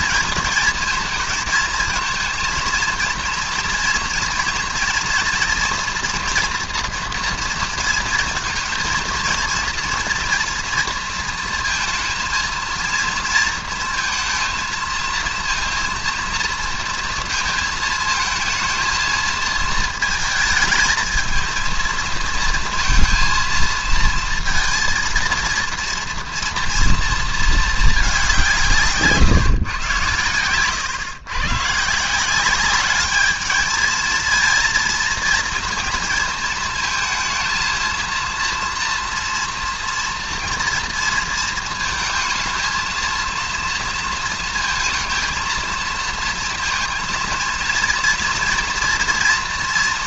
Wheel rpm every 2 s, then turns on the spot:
230, 230, 230, 230, 230, 230, 230, 220, 230, 220, 220, 230, 230, 230, 170, 110, 190, 230, 220, 230, 230, 220, 230, 230, 230.
none